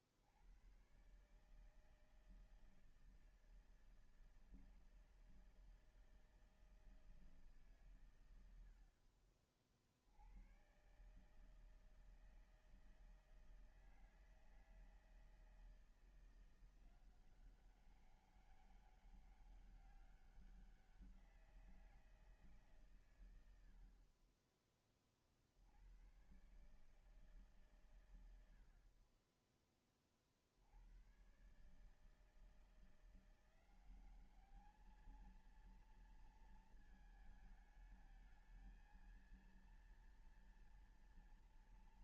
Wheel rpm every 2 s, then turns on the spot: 120, 160, 160, 160, 70, 130, 160, 160, 180, 200, 180, 130, 30, 150, 50, 100, 170, 220, 230, 220, 230.
none